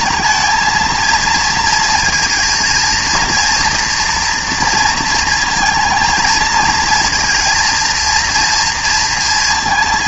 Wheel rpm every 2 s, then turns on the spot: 230, 230, 230, 220, 230.
none